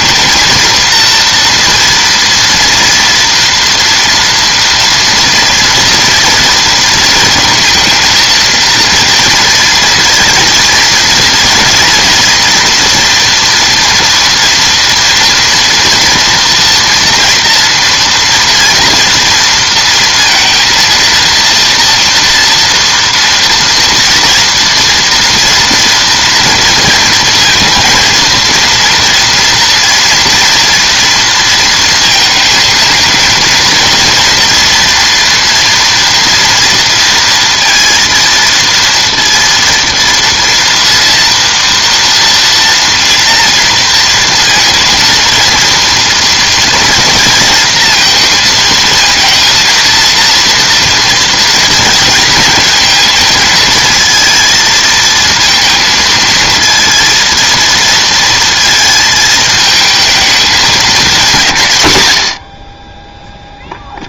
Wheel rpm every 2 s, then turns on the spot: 230, 230, 230, 230, 230, 230, 240, 230, 230, 240, 230, 230, 230, 230, 230, 240, 220, 240, 230, 230, 230, 230, 230, 230, 220, 230, 220, 230, 230, 230, 210, 30.
none